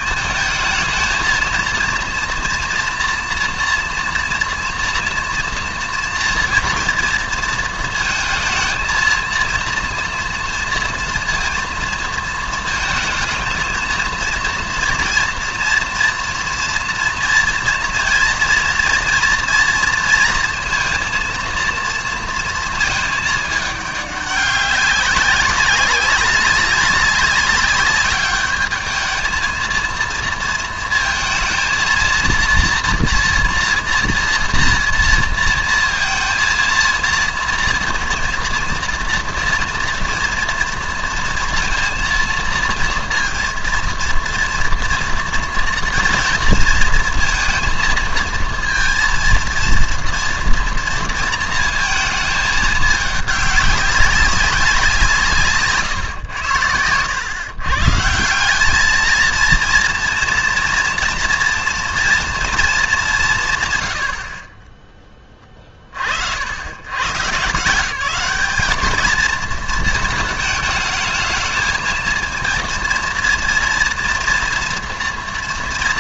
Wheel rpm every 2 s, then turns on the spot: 220, 230, 230, 230, 230, 240, 220, 230, 240, 230, 230, 230, 200, 190, 210, 230, 230, 240, 230, 230, 230, 230, 230, 230, 230, 230, 220, 190, 110, 190, 230, 220, 40, 80, 210, 220, 230, 230.
none